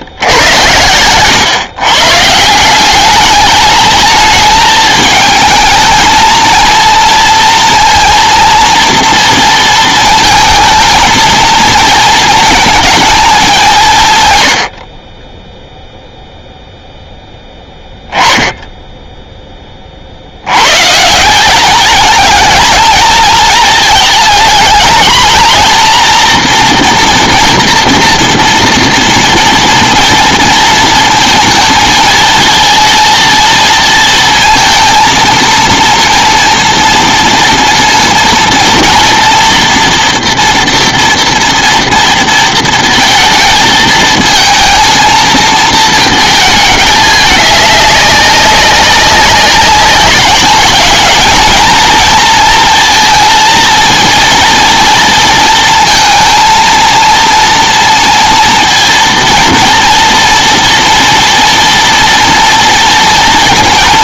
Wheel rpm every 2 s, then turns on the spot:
110, 170, 210, 230, 230, 220, 220, 90, 0, 10, 110, 220, 230, 240, 230, 230, 230, 230, 230, 230, 240, 230, 220, 220, 190, 210, 230, 230, 230, 230, 230, 230.
none